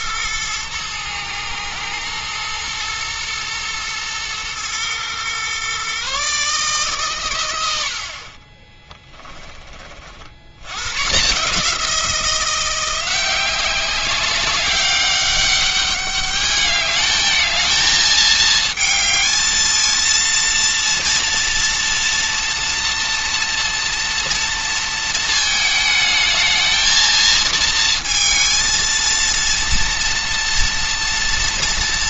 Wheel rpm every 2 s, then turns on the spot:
110, 110, 120, 140, 20, 120, 180, 200, 210, 220, 230, 240, 230, 220, 230, 240.
8-10